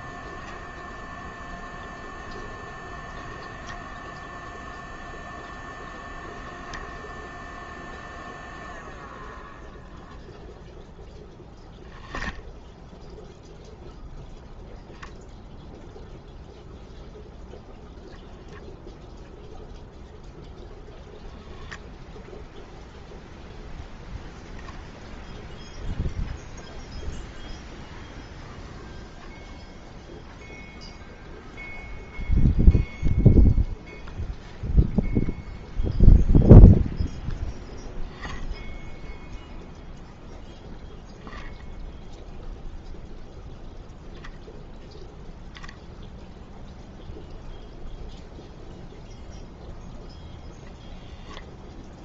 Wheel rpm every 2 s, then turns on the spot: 0, 0, 0, 0, 0, 0, 0, 0, 0, 0, 10, 0, 0, 0, 0, 0, 0, 0, 0, 0, 0, 0, 0, 0, 0, 0.
none